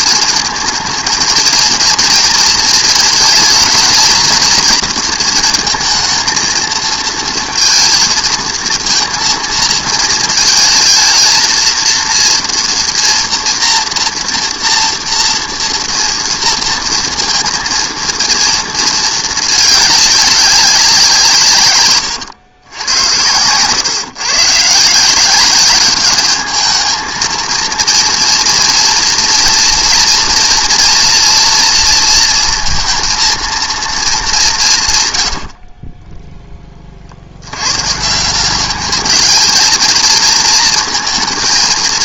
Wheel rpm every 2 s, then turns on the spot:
220, 230, 230, 220, 220, 220, 230, 230, 230, 230, 190, 100, 150, 210, 230, 230, 230, 160, 20, 200, 230.
none